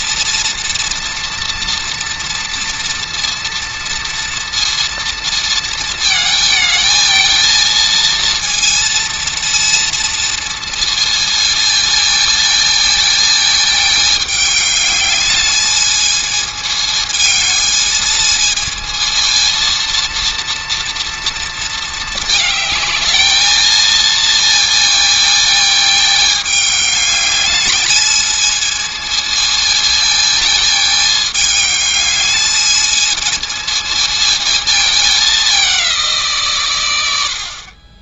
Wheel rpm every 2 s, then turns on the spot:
240, 230, 230, 220, 230, 230, 220, 210, 220, 220, 230, 220, 230, 210, 220, 220, 220, 220, 100.
none